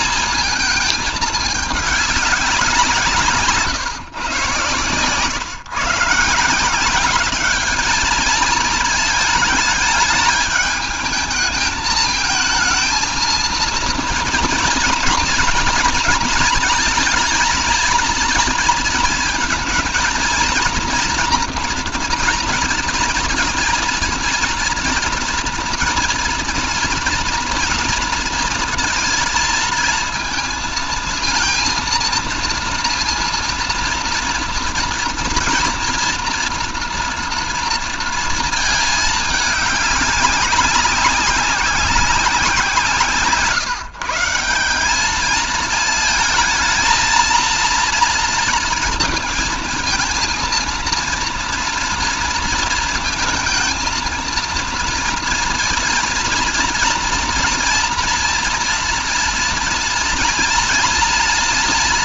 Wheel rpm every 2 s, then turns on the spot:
220, 170, 130, 180, 220, 220, 230, 230, 220, 230, 230, 230, 230, 230, 230, 230, 230, 230, 240, 220, 200, 170, 180, 230, 230, 230, 230, 230, 230, 230, 230.
none